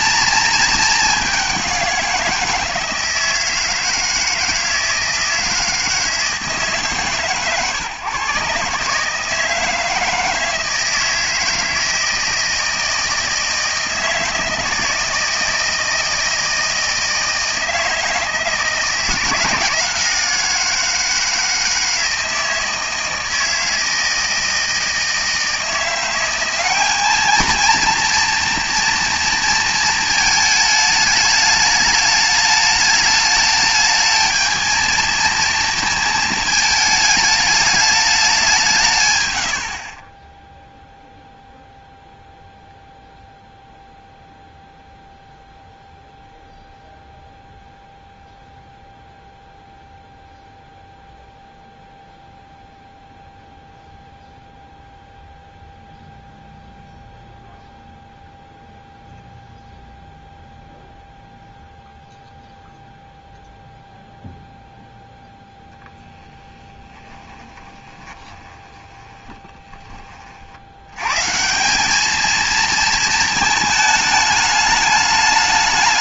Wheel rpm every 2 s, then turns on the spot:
220, 170, 160, 140, 140, 160, 160, 160, 160, 160, 170, 160, 160, 200, 230, 210, 210, 220, 220, 170, 0, 0, 0, 0, 0, 0, 0, 0, 0, 0, 0, 0, 0, 20, 20, 90, 230, 210.
66-70